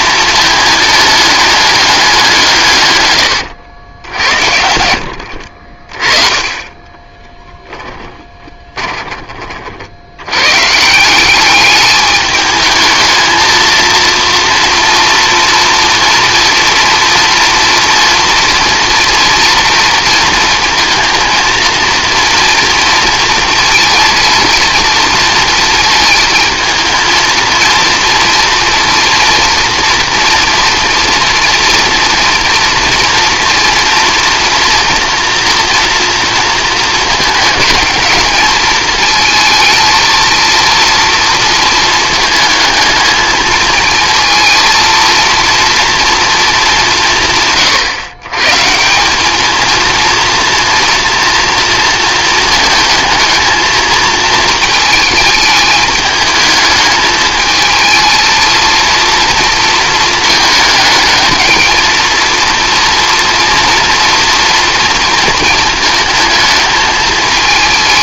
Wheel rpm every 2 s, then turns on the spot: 220, 150, 70, 20, 20, 140, 220, 240, 240, 230, 220, 230, 230, 220, 230, 240, 230, 230, 230, 220, 230, 220, 230, 210, 160, 230, 220, 220, 220, 230, 220, 230, 230, 220.
6-8